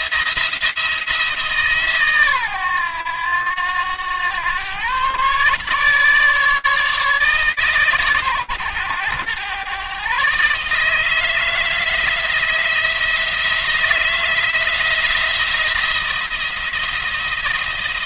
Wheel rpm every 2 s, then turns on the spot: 160, 110, 120, 140, 110, 160, 160, 170, 170.
none